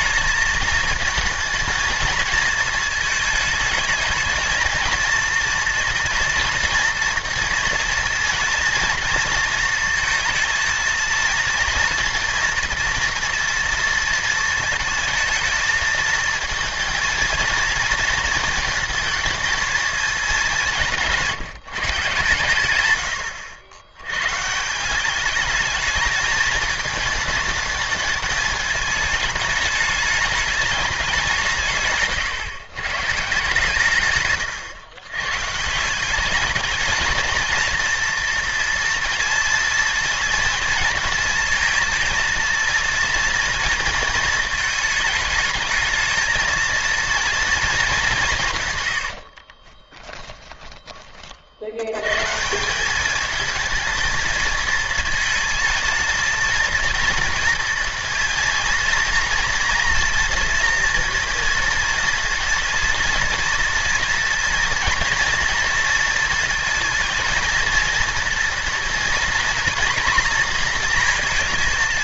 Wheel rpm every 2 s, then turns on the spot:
220, 220, 230, 240, 230, 230, 230, 230, 230, 220, 190, 100, 160, 220, 210, 200, 120, 110, 210, 230, 230, 230, 220, 230, 140, 20, 170, 220, 230, 230, 230, 230, 230, 230, 230, 230.
34-36 48-52